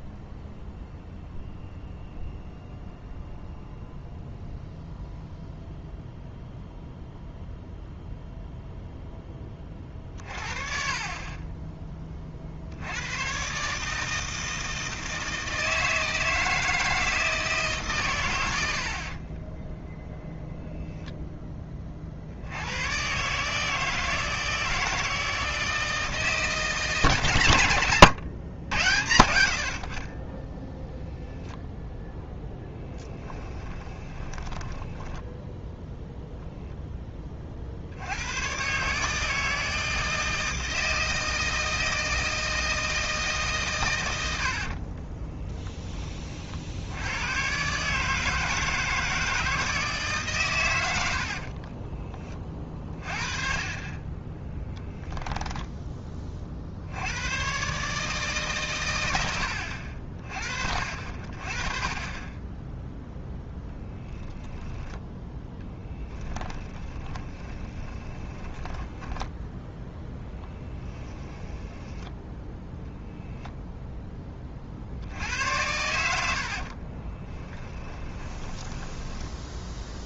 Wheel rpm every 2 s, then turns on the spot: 0, 0, 0, 0, 0, 30, 80, 160, 160, 60, 0, 110, 160, 150, 90, 0, 20, 10, 0, 140, 160, 160, 40, 80, 160, 90, 30, 10, 70, 110, 50, 0, 10, 10, 10, 10, 0, 50, 40, 10.
18-20 32-36 44-46 54-56 66-72 76-80